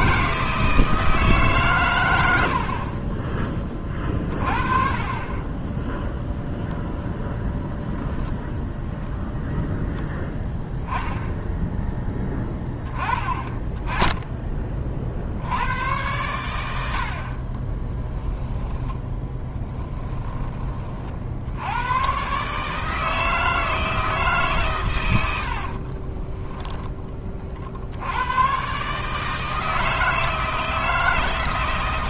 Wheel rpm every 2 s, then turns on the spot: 160, 40, 30, 0, 0, 10, 20, 40, 80, 10, 30, 160, 110, 10, 140, 160.
18-20